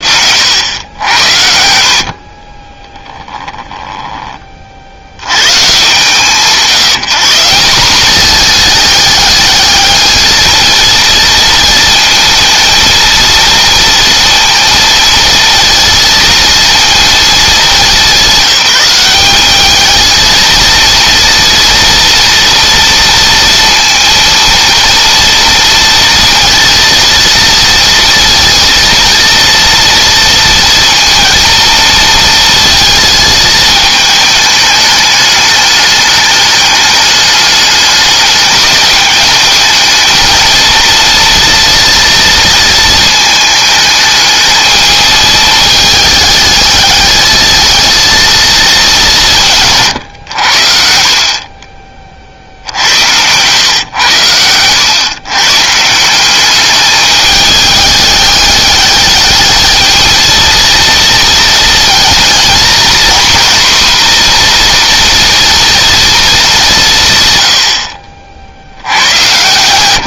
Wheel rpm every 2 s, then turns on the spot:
90, 20, 40, 160, 210, 220, 230, 230, 230, 190, 230, 230, 230, 230, 230, 230, 230, 210, 210, 200, 230, 230, 220, 210, 210, 70, 70, 100, 200, 210, 230, 230, 240, 190, 90.
2-4 50-52